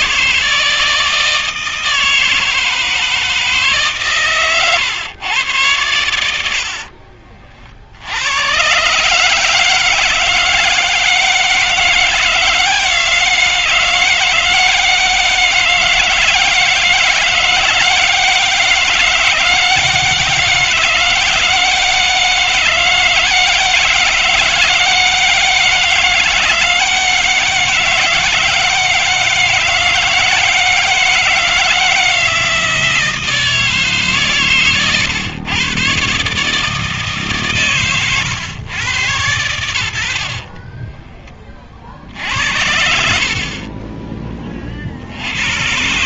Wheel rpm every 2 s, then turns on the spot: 160, 160, 130, 70, 120, 160, 160, 160, 160, 160, 160, 160, 160, 160, 160, 160, 160, 130, 150, 120, 40, 80, 30.
34-36 40-44